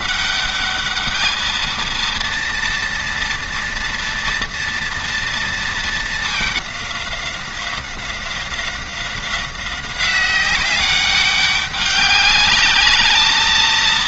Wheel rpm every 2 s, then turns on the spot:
200, 230, 230, 210, 180, 190, 200.
none